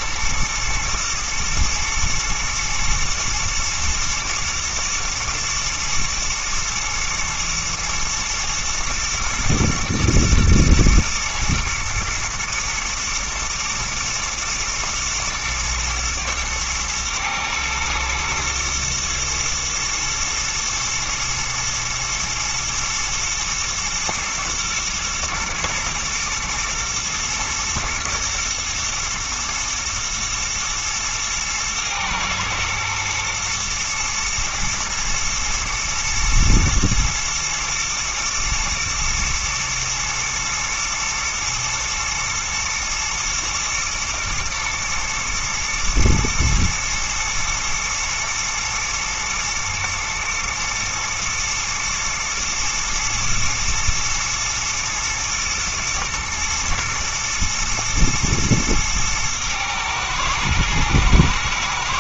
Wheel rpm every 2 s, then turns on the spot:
120, 110, 110, 110, 110, 120, 120, 110, 110, 120, 110, 120, 110, 120, 110, 110, 120, 120, 110, 120, 120, 110, 110, 110, 110, 120, 110, 120, 110, 110, 110.
none